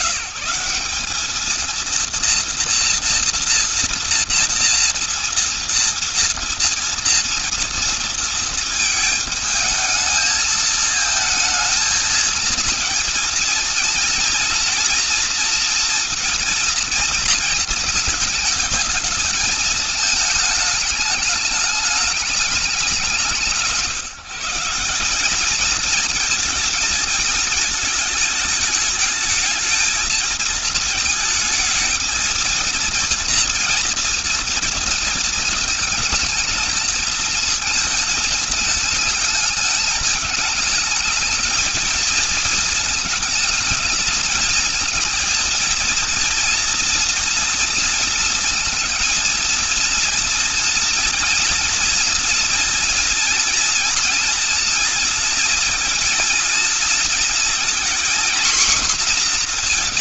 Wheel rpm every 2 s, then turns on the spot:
150, 230, 230, 230, 230, 220, 220, 230, 230, 220, 220, 200, 160, 220, 220, 220, 230, 230, 220, 220, 210, 230, 220, 230, 230, 230, 230, 230, 230, 240.
none